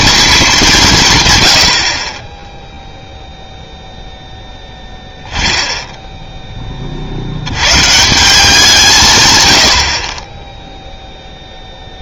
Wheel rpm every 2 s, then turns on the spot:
180, 0, 10, 40, 160, 0.
none